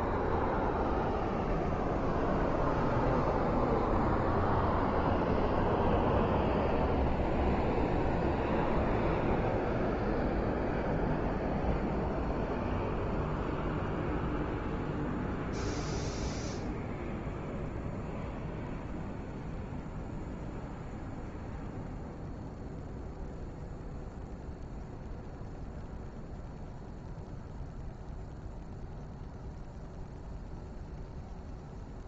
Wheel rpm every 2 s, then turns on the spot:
0, 0, 0, 0, 0, 0, 0, 0, 0, 0, 0, 0, 0, 0, 0, 0.
none